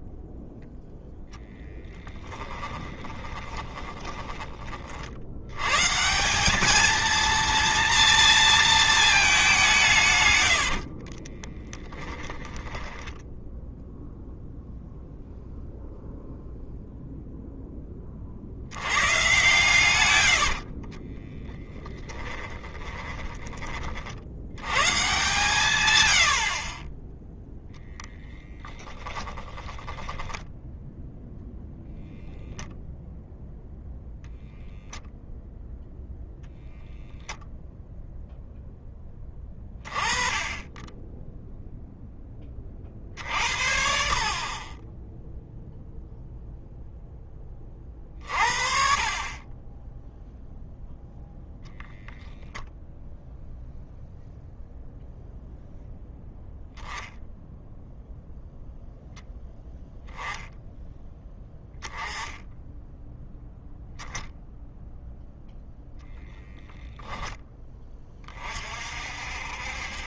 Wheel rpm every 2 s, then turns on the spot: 0, 20, 60, 220, 220, 40, 10, 0, 0, 100, 30, 20, 140, 20, 10, 0, 0, 0, 0, 10, 10, 50, 20, 0, 40, 0, 0, 0, 0, 0, 10, 10, 0, 10, 50.
2-4 10-12 20-24 28-30